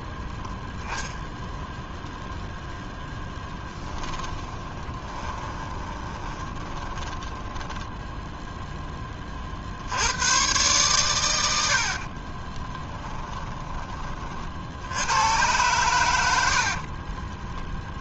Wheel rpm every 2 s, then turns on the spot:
0, 0, 10, 20, 10, 130, 20, 80, 50.
4-8 12-14 16-18